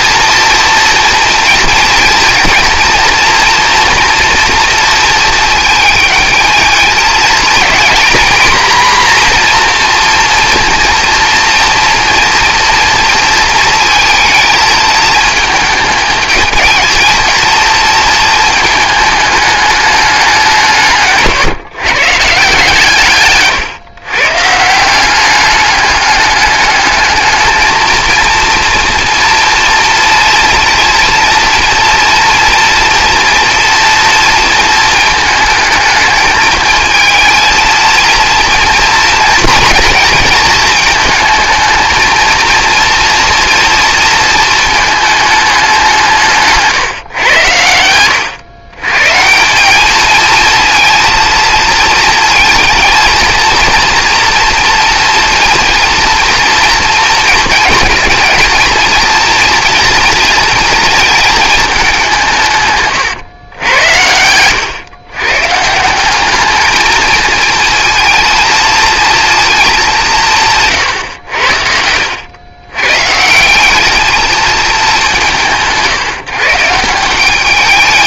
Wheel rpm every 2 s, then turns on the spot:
230, 230, 220, 240, 230, 240, 220, 220, 220, 170, 150, 160, 210, 230, 230, 230, 230, 230, 240, 220, 230, 220, 150, 120, 230, 220, 230, 230, 230, 230, 140, 100, 210, 230, 150, 110, 210, 150, 220.
none